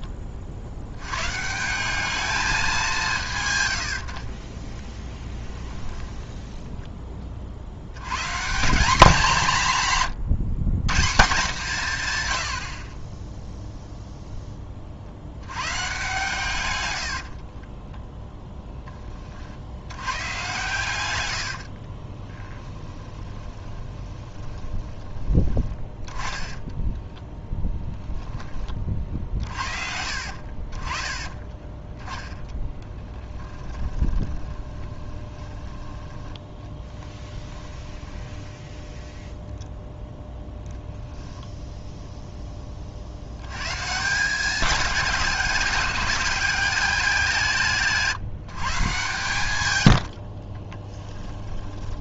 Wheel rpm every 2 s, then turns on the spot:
80, 190, 10, 10, 190, 140, 40, 30, 100, 10, 110, 10, 20, 10, 30, 30, 10, 20, 10, 0, 0, 40, 210, 210, 140, 20.
4-6 16-18 22-28 32-38 50-52